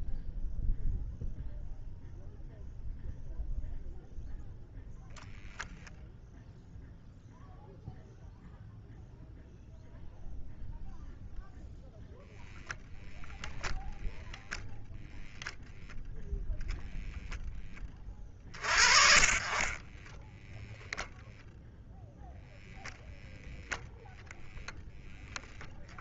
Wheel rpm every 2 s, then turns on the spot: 0, 0, 0, 0, 0, 0, 0, 0, 10, 30, 10, 0, 0.
20-22